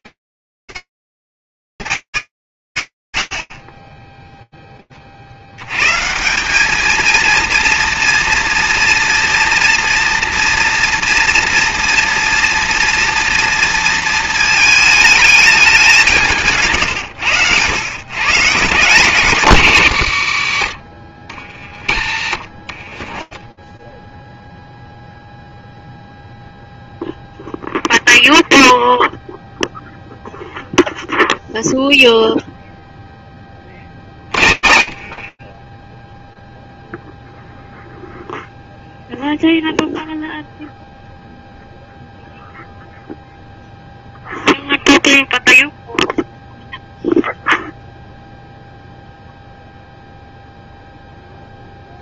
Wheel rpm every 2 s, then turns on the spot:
110, 90, 30, 220, 230, 230, 230, 220, 120, 160, 70, 20, 0, 0, 0, 0, 60, 10, 0, 0, 0, 0, 0, 0, 0, 0.
22-24 32-34